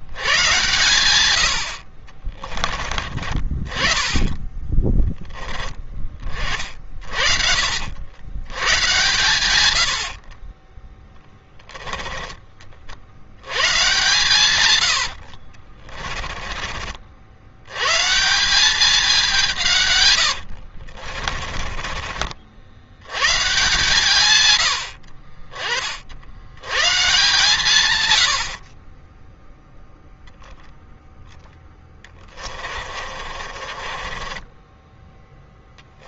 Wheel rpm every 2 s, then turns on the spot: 110, 30, 20, 40, 110, 30, 40, 100, 30, 190, 60, 70, 90, 110, 50, 0, 30, 20.
4-8 10-12 14-16 20-22 32-36